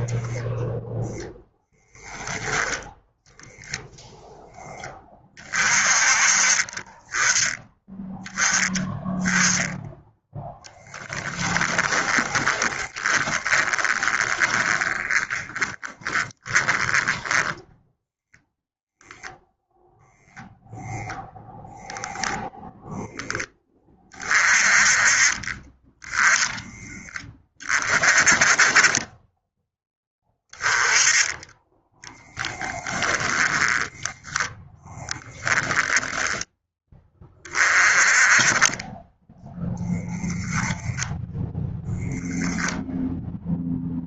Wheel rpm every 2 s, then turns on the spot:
0, 0, 10, 30, 10, 10, 30, 30, 10, 0, 0, 0, 30, 10, 20, 10, 20, 10, 20, 20, 10, 0.
10-18 32-34